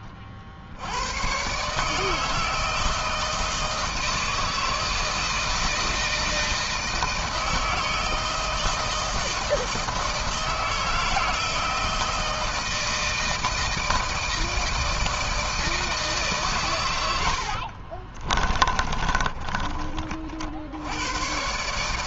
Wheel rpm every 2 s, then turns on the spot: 90, 160, 160, 160, 160, 160, 160, 160, 110, 30, 90.
16-20